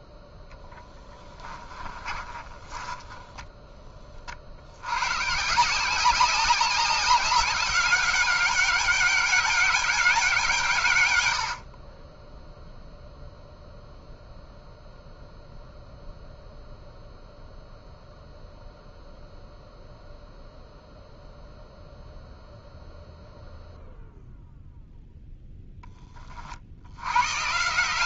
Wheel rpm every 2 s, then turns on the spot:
10, 20, 90, 190, 190, 130, 0, 0, 0, 0, 0, 0, 0, 80.
0-4